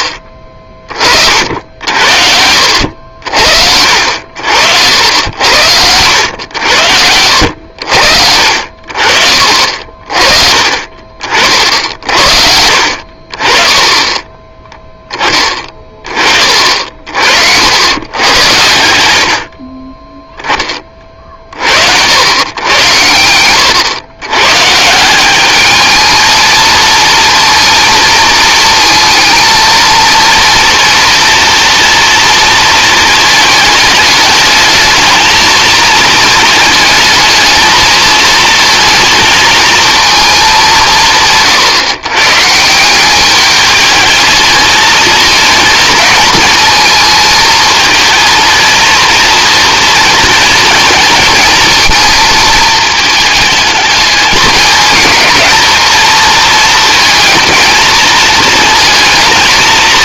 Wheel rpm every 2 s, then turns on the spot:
30, 70, 70, 80, 60, 40, 60, 10, 50, 90, 20, 110, 140, 220, 230, 240, 220, 220, 220, 230, 180, 170, 220, 220, 230, 230, 220, 220, 230, 230.
8-10